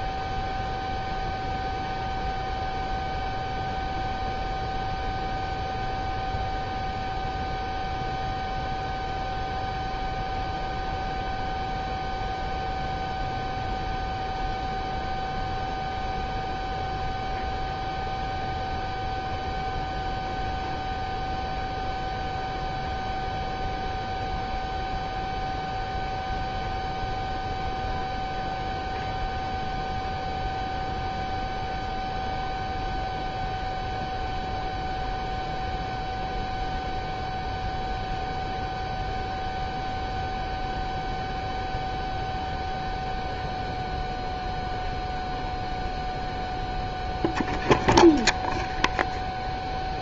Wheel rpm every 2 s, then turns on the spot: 0, 0, 0, 0, 0, 0, 0, 0, 0, 0, 0, 0, 0, 0, 0, 0, 0, 0, 0, 0, 0, 0, 0, 0, 0.
none